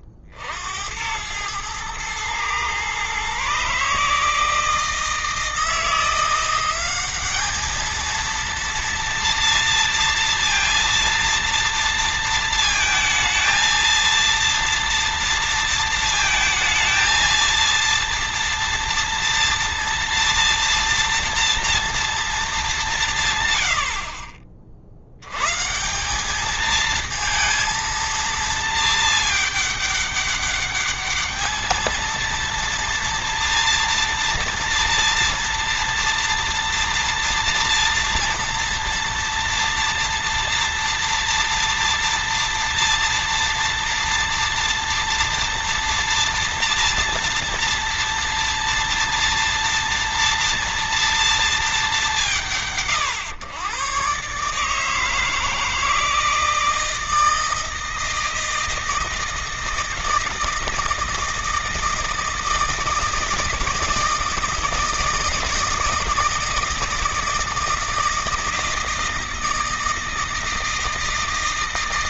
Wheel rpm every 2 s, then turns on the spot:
90, 120, 160, 190, 230, 230, 220, 230, 230, 230, 240, 190, 60, 220, 220, 210, 230, 230, 230, 230, 230, 230, 230, 230, 230, 230, 110, 160, 160, 160, 160, 160, 160, 160, 160, 160.
none